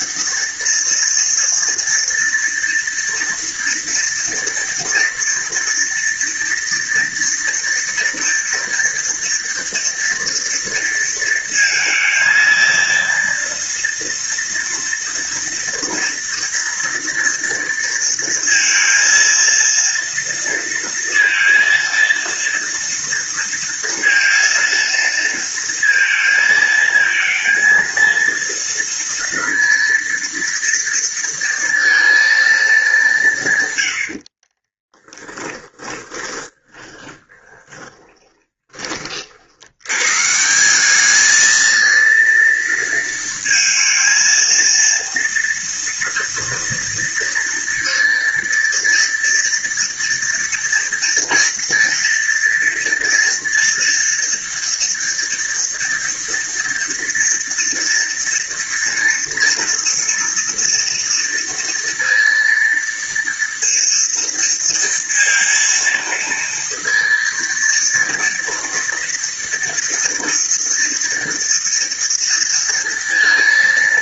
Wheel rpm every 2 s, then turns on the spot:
230, 230, 230, 230, 230, 230, 230, 230, 230, 230, 230, 230, 230, 230, 230, 230, 190, 30, 20, 50, 200, 230, 230, 230, 230, 230, 230, 230, 230, 230, 230, 230, 230, 230, 230, 240, 230.
34-38